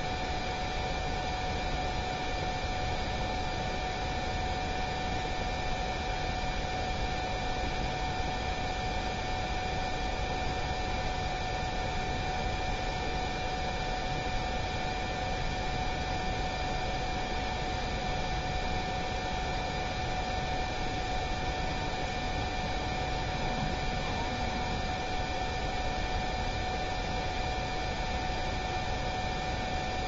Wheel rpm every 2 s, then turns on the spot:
0, 0, 0, 0, 0, 0, 0, 0, 0, 0, 0, 0, 0, 0, 0.
none